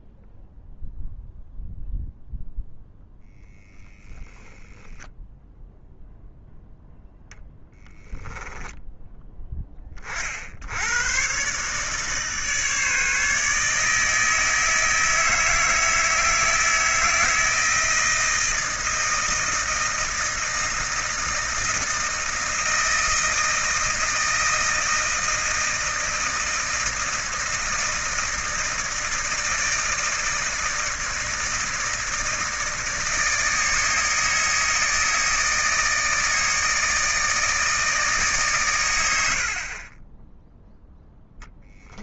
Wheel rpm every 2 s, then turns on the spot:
0, 0, 0, 0, 10, 70, 150, 160, 160, 160, 160, 160, 160, 160, 160, 160, 160, 160, 160, 110, 0.
8-10